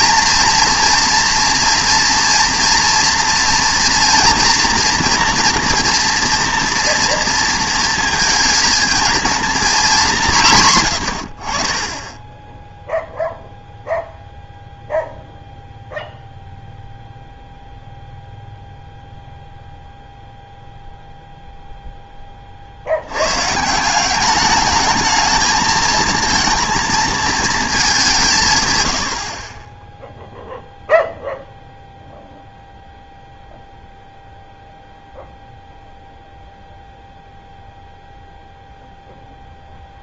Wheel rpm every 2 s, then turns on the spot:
240, 240, 230, 230, 230, 140, 0, 0, 0, 0, 0, 60, 200, 230, 120, 0, 0, 0, 0, 0.
none